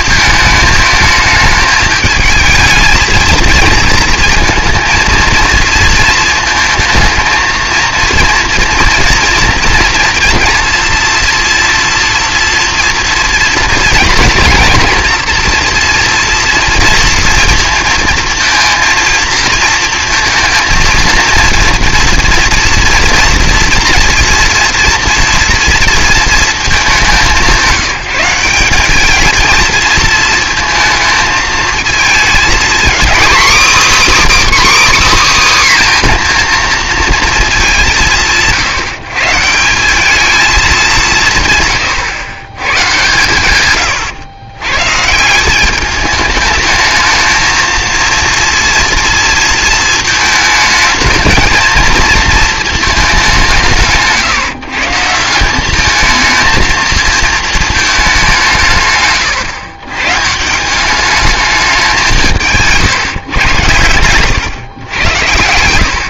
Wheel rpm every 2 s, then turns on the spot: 220, 220, 230, 220, 230, 230, 230, 230, 230, 230, 230, 230, 240, 220, 180, 230, 240, 320, 240, 160, 200, 120, 110, 210, 230, 220, 220, 150, 230, 160, 170, 160, 110.
none